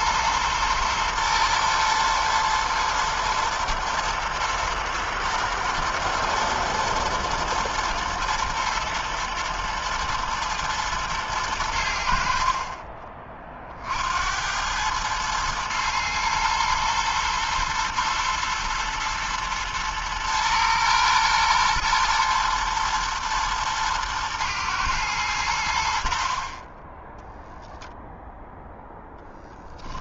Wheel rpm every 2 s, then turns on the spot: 110, 110, 120, 120, 120, 110, 70, 70, 110, 110, 120, 120, 120, 50, 0.
none